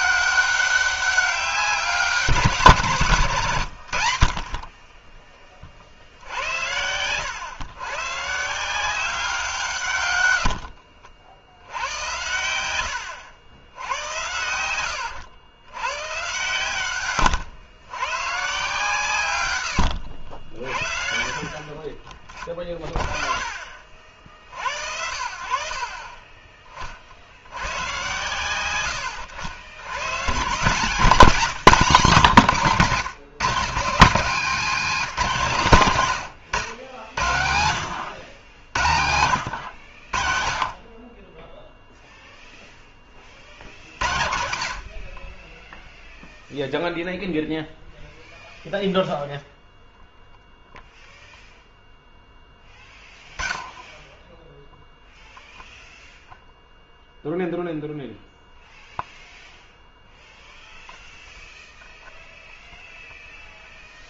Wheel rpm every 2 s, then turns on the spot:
200, 160, 20, 100, 180, 60, 90, 90, 120, 140, 40, 30, 60, 40, 90, 160, 150, 220, 90, 80, 30, 20, 50, 0, 0, 0, 10, 0, 0, 0, 0, 0.
10-12 14-16 24-26